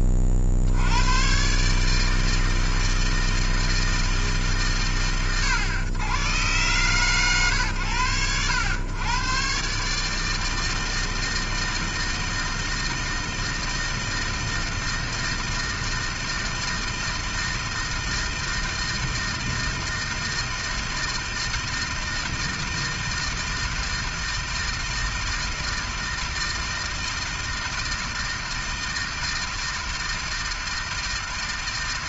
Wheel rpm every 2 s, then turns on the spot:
90, 160, 120, 120, 110, 160, 160, 160, 160, 160, 160, 160, 160, 160, 160, 160.
none